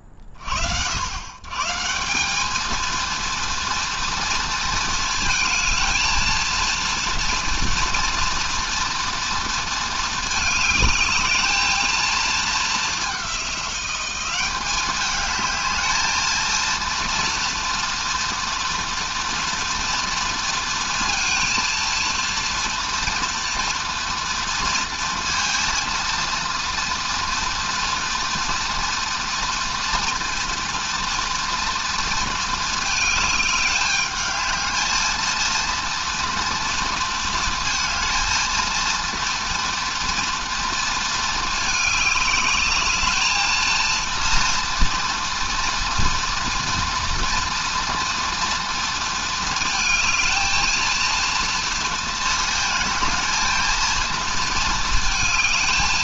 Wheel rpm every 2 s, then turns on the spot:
40, 210, 230, 230, 240, 220, 210, 190, 230, 230, 230, 230, 240, 230, 230, 230, 220, 210, 240, 230, 230, 210, 230, 230, 230, 220, 220, 230.
none